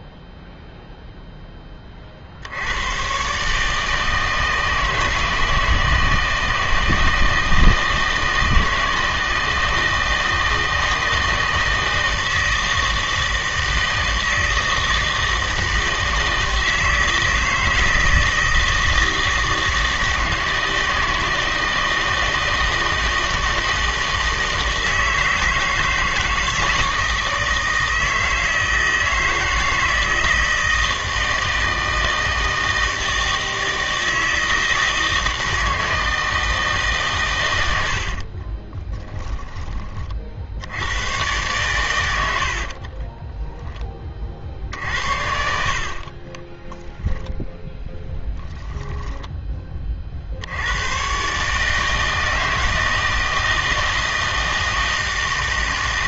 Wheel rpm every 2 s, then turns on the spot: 0, 80, 160, 160, 160, 160, 160, 160, 160, 160, 160, 160, 160, 160, 160, 160, 160, 160, 160, 30, 70, 60, 70, 20, 10, 80, 160, 160.
38-40 42-44 46-50